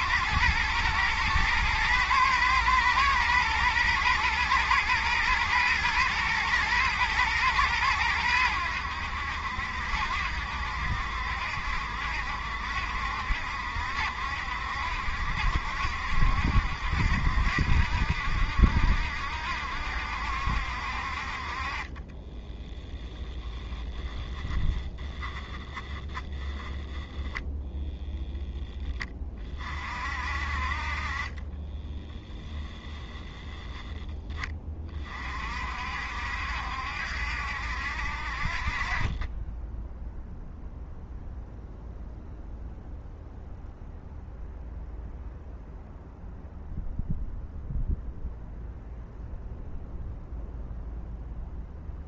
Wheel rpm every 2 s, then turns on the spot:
110, 110, 120, 120, 90, 70, 70, 70, 70, 70, 60, 10, 10, 0, 10, 40, 10, 30, 70, 30, 0, 0, 0, 0, 0, 0.
none